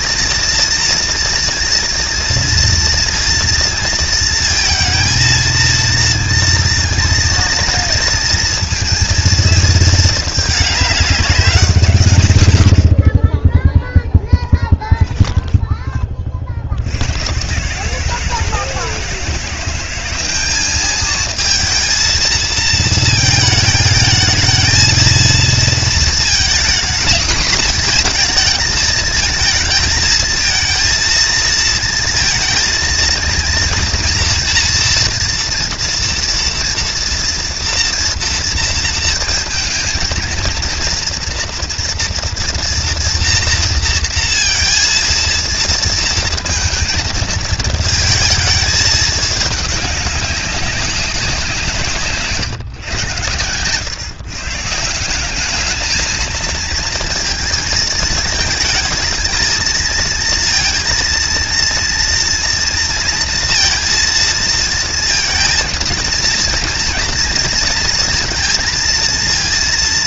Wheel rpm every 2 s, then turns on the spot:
230, 230, 230, 230, 230, 210, 70, 20, 80, 160, 210, 220, 230, 230, 220, 220, 230, 230, 230, 230, 230, 240, 230, 230, 220, 190, 110, 170, 230, 220, 230, 230, 230, 230, 230.
14-16